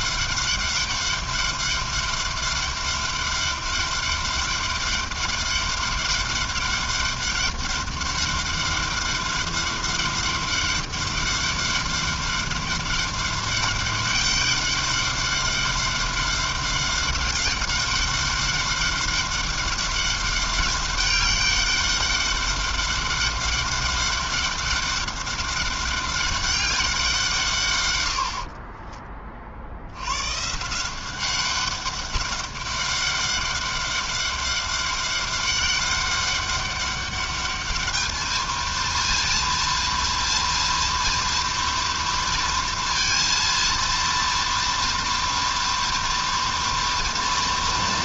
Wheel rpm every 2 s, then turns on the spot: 200, 200, 200, 200, 200, 200, 200, 200, 200, 200, 200, 200, 200, 150, 40, 190, 200, 200, 210, 230, 230, 230, 230, 220.
none